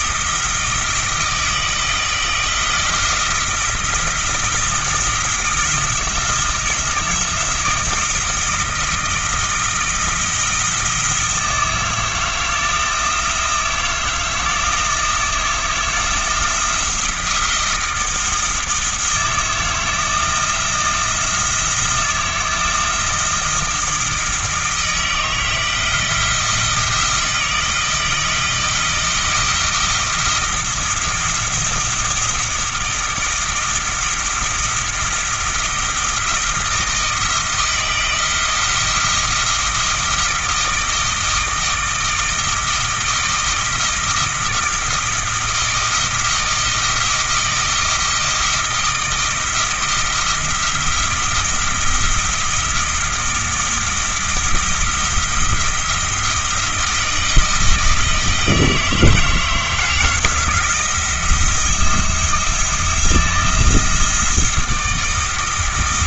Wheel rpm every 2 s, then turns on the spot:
160, 160, 170, 160, 160, 160, 160, 160, 160, 160, 170, 170, 160, 160, 160, 170, 170, 170, 160, 170, 160, 160, 160, 160, 170, 170, 170, 170, 160, 160, 170, 170, 170.
none